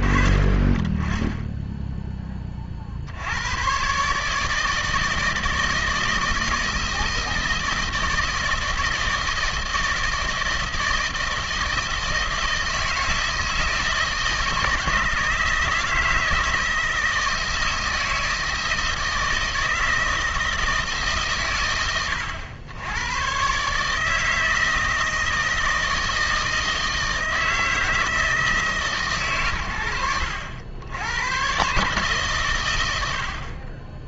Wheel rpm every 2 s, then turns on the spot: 30, 30, 160, 160, 160, 160, 160, 160, 160, 160, 160, 80, 160, 160, 150, 80, 120.
none